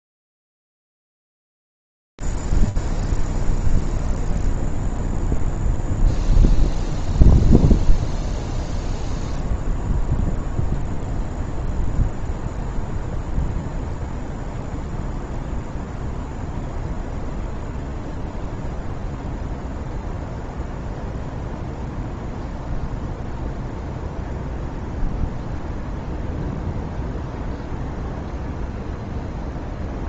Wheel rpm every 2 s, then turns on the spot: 0, 0, 0, 0, 0, 0, 0, 0, 0, 0, 0, 0, 0, 0, 0.
none